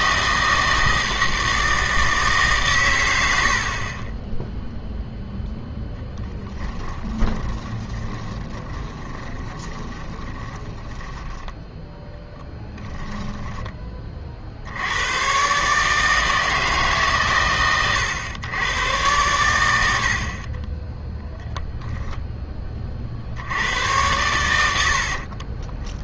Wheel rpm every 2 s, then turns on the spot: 160, 140, 0, 10, 20, 20, 10, 70, 150, 110, 30, 30, 80.
6-14